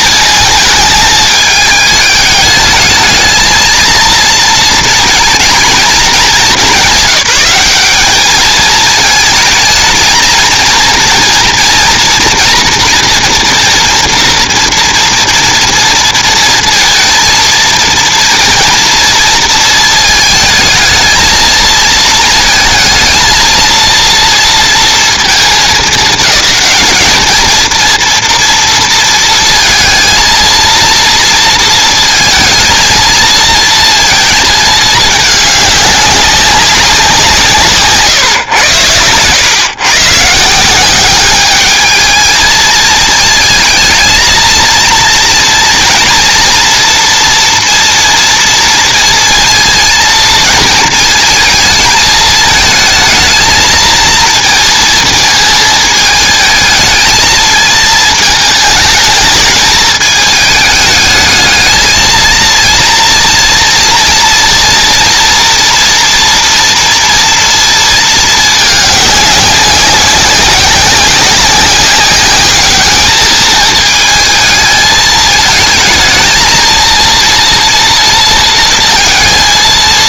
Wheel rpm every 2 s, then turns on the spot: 220, 210, 230, 190, 220, 230, 240, 230, 230, 230, 220, 220, 230, 220, 230, 230, 230, 220, 200, 120, 160, 220, 230, 230, 230, 230, 220, 230, 220, 210, 210, 230, 240, 230, 220, 190, 200, 220, 230, 230.
none